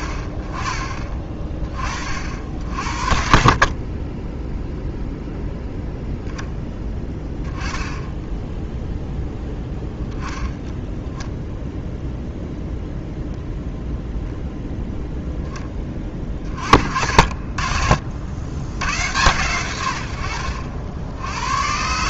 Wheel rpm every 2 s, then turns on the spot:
30, 60, 0, 10, 0, 0, 0, 0, 50, 100, 70.
none